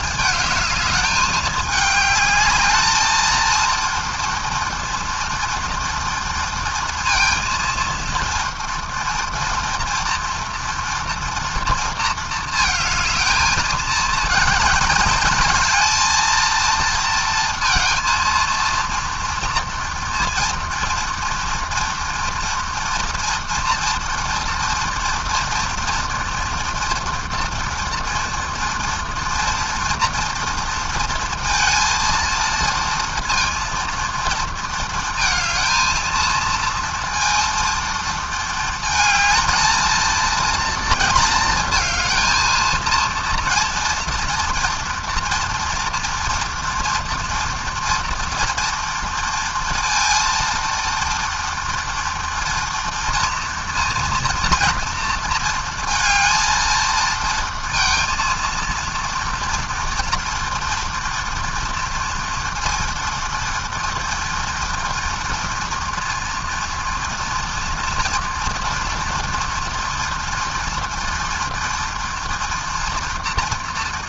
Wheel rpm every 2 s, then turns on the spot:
210, 230, 230, 230, 240, 230, 220, 220, 230, 230, 240, 230, 230, 230, 230, 230, 230, 220, 230, 230, 230, 230, 240, 240, 230, 230, 230, 230, 230, 230, 230, 230, 230, 230, 230, 230, 230.
none